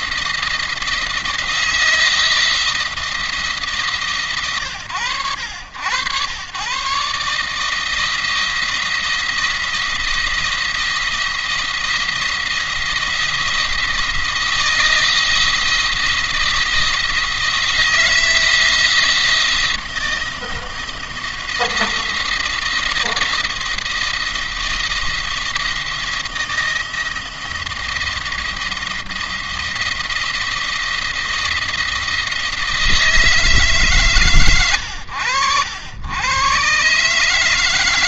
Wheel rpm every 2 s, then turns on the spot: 170, 170, 110, 130, 170, 170, 170, 170, 160, 170, 170, 170, 170, 170, 170, 170, 160, 110, 130.
none